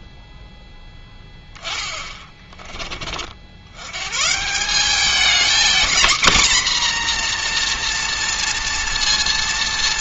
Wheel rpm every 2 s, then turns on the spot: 10, 30, 190, 240, 230.
none